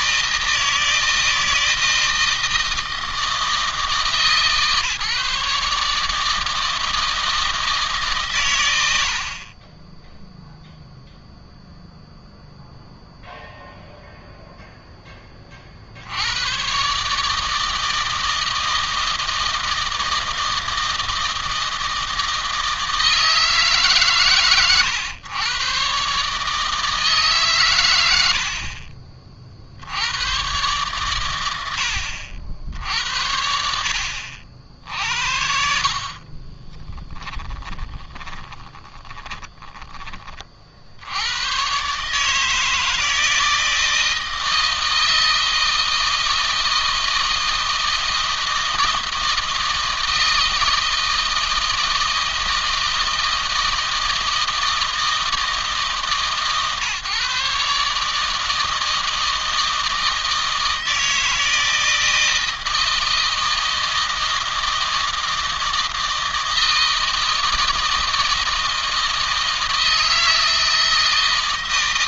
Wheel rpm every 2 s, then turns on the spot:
160, 160, 150, 160, 110, 0, 0, 0, 120, 160, 160, 160, 120, 150, 60, 110, 60, 70, 30, 20, 40, 160, 160, 160, 160, 160, 160, 160, 150, 160, 160, 160, 160, 160, 160, 160.
36-40